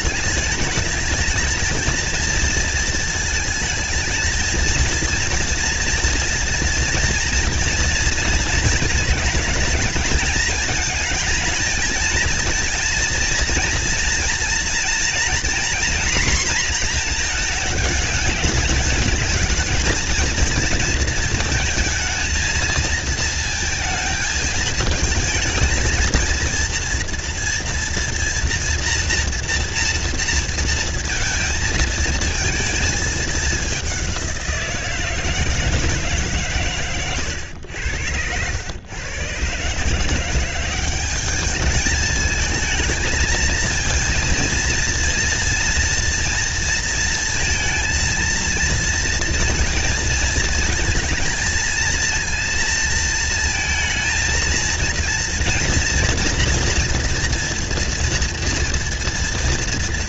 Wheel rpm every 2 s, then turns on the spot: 210, 230, 220, 230, 230, 220, 230, 230, 240, 210, 230, 230, 220, 230, 230, 230, 220, 170, 130, 110, 180, 210, 230, 230, 230, 230, 230, 230, 240, 230.
none